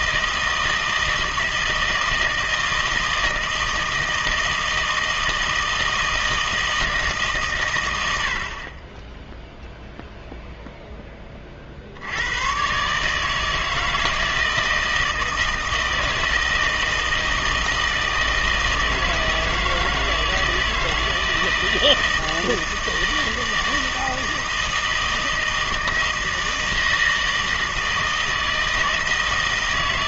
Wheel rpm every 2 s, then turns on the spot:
160, 160, 160, 160, 30, 0, 130, 160, 160, 160, 160, 160, 160, 160, 160.
none